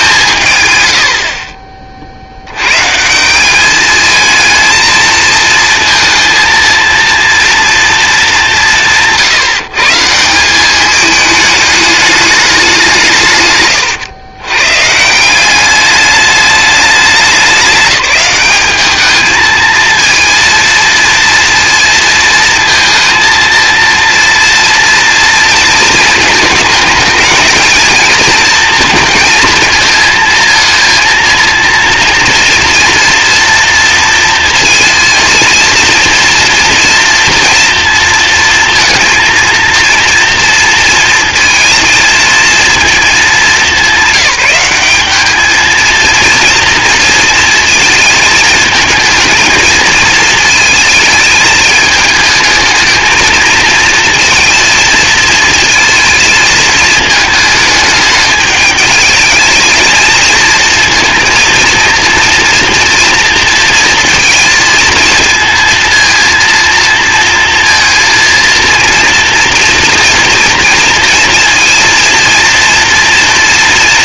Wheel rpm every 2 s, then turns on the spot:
120, 130, 220, 230, 180, 200, 190, 140, 210, 200, 230, 230, 230, 220, 230, 230, 230, 230, 230, 230, 230, 230, 200, 230, 220, 220, 220, 230, 220, 220, 230, 230, 220, 230, 230, 230, 230.
none